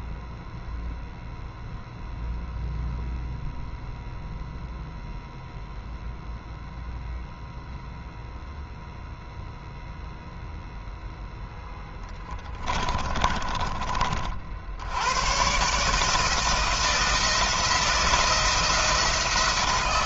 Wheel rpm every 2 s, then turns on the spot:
0, 0, 0, 0, 0, 0, 20, 90, 160, 170.
12-14